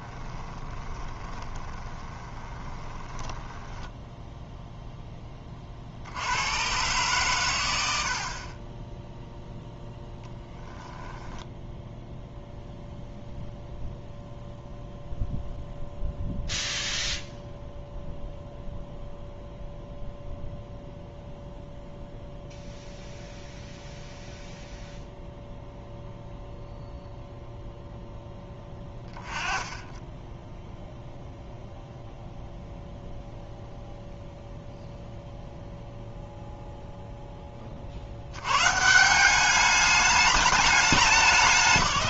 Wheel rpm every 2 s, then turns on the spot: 20, 20, 0, 90, 40, 10, 0, 0, 0, 0, 0, 0, 0, 0, 10, 10, 0, 0, 0, 150, 190.
0-4 30-32